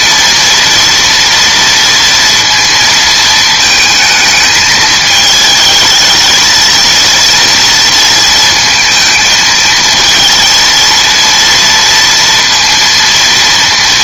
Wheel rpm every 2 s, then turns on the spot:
230, 230, 220, 230, 220, 230, 230.
none